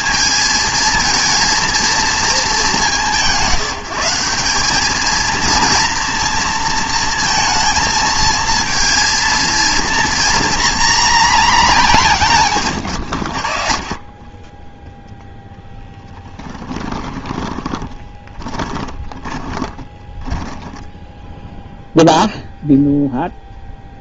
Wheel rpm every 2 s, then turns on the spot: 220, 200, 200, 230, 230, 240, 130, 10, 20, 20, 10, 0.
16-22